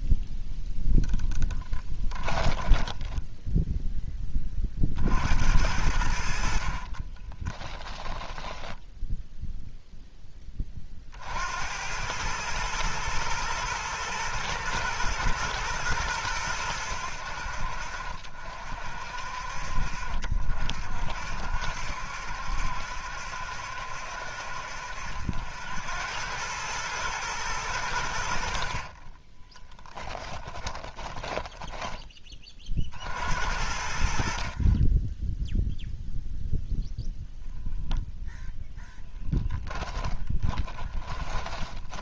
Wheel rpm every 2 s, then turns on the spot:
0, 10, 40, 40, 10, 20, 110, 110, 90, 50, 50, 70, 70, 110, 50, 20, 40, 50, 0, 10, 20.
2-4 6-10 30-32 40-42